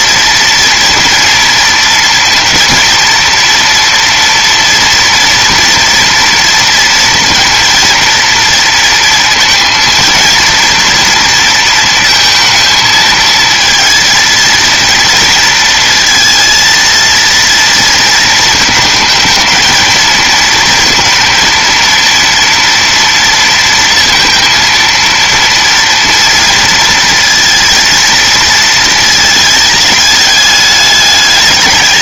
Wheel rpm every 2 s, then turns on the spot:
230, 230, 230, 230, 230, 230, 220, 230, 230, 220, 230, 230, 230, 230, 220, 210.
none